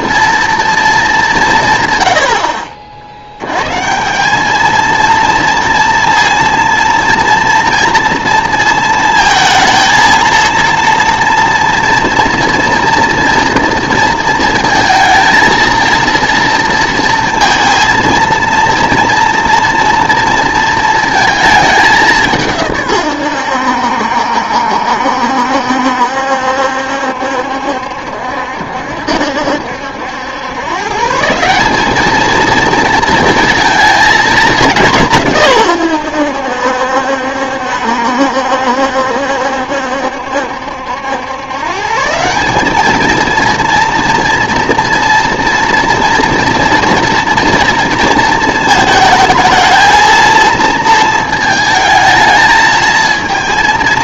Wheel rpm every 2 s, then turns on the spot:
230, 60, 220, 230, 230, 230, 230, 230, 230, 230, 230, 140, 70, 70, 70, 120, 230, 200, 70, 70, 70, 200, 230, 230, 220, 230, 220.
none